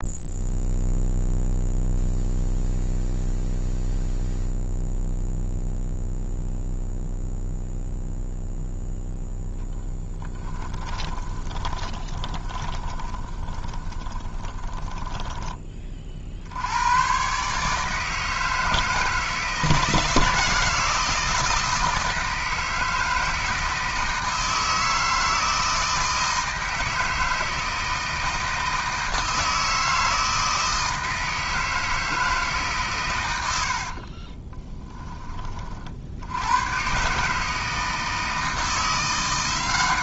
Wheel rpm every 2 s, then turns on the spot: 0, 0, 0, 0, 0, 10, 20, 20, 90, 160, 160, 160, 160, 160, 160, 160, 140, 20, 120, 170.
10-16